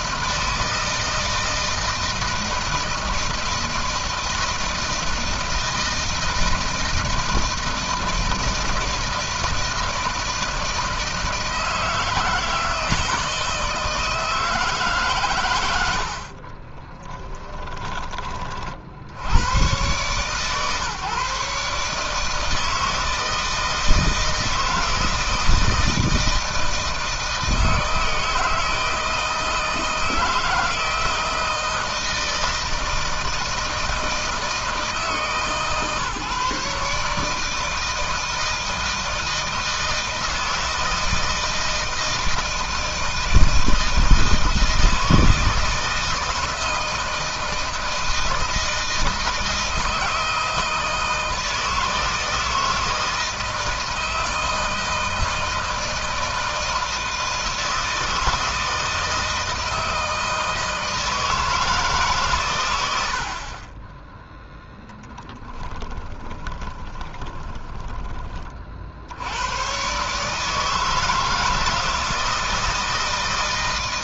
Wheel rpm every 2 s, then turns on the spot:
160, 160, 160, 160, 160, 160, 160, 150, 30, 40, 130, 160, 160, 160, 160, 160, 160, 160, 150, 160, 160, 160, 160, 160, 160, 160, 160, 160, 160, 160, 160, 110, 10, 20, 40, 150, 160.
16-18 64-68